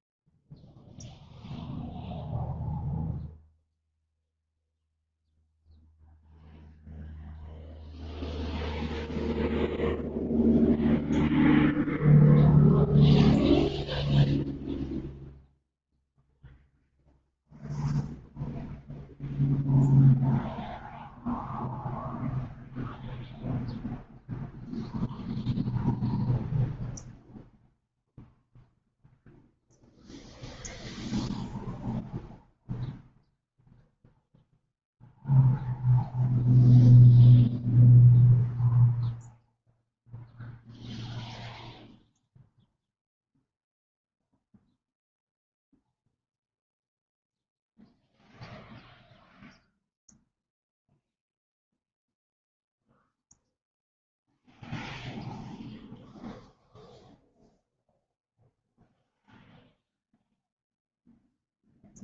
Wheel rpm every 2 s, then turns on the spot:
0, 0, 0, 0, 0, 0, 0, 0, 0, 0, 0, 0, 0, 0, 0, 0, 0, 0, 0, 0, 0, 0, 0, 0, 0, 0, 0, 0, 0, 0, 0.
none